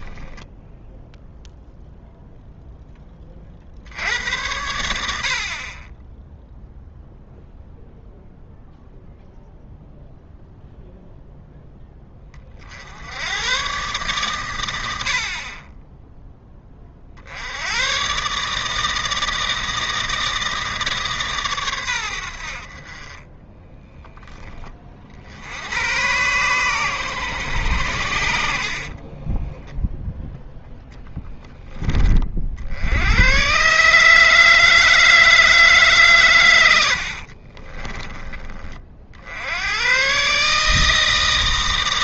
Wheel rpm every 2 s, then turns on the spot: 0, 10, 80, 0, 0, 0, 60, 90, 20, 150, 160, 50, 30, 120, 40, 0, 70, 160, 90, 40, 160.
28-30